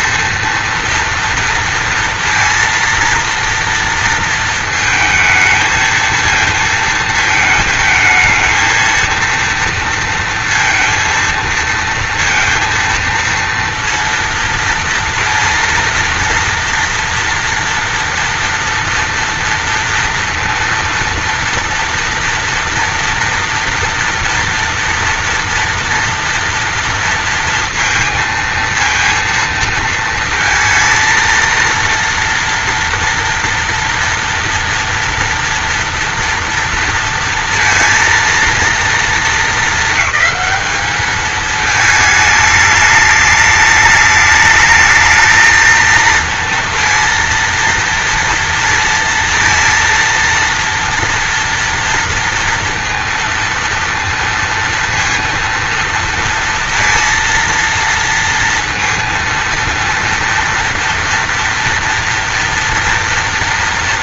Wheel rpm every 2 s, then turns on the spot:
230, 230, 220, 220, 230, 230, 230, 230, 230, 230, 230, 230, 230, 230, 230, 230, 230, 230, 230, 230, 210, 210, 220, 230, 230, 230, 230, 230, 230, 230, 230, 230.
none